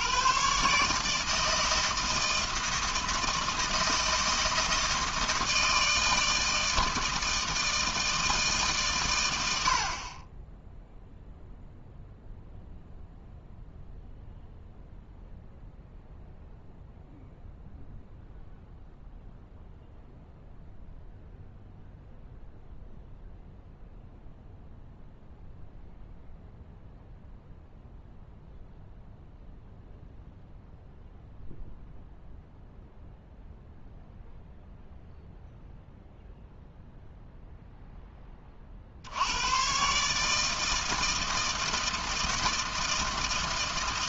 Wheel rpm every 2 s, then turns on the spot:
140, 160, 160, 160, 140, 10, 0, 0, 0, 0, 0, 0, 0, 0, 0, 0, 0, 0, 0, 40, 160, 160.
none